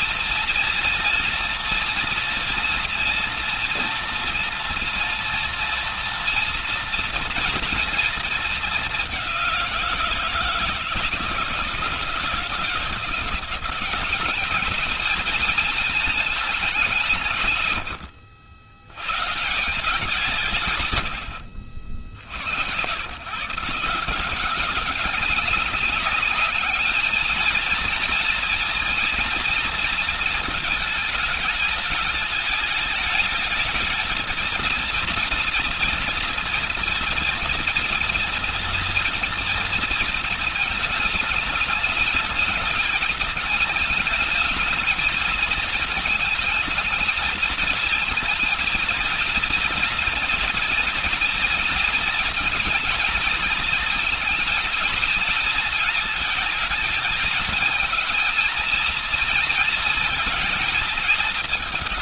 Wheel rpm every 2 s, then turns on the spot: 230, 230, 230, 230, 210, 170, 170, 210, 190, 100, 150, 70, 190, 210, 230, 220, 210, 230, 230, 230, 220, 220, 220, 220, 230, 230, 220, 220, 220, 230, 230.
none